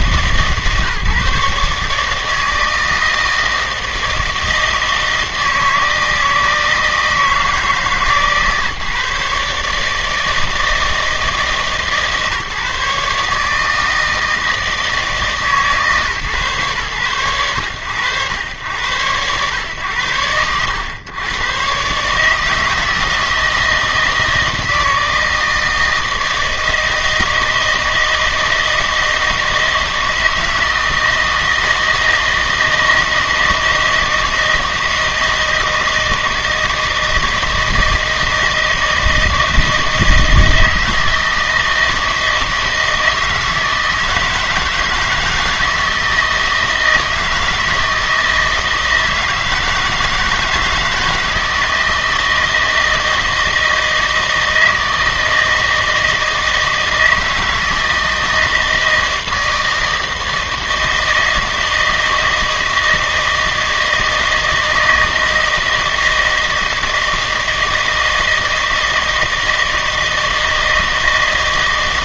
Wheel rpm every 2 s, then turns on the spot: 140, 160, 160, 160, 140, 160, 150, 160, 130, 100, 110, 160, 160, 160, 160, 160, 160, 160, 160, 160, 160, 160, 160, 160, 160, 160, 160, 160, 160, 160, 160, 160, 160, 160, 160, 160.
none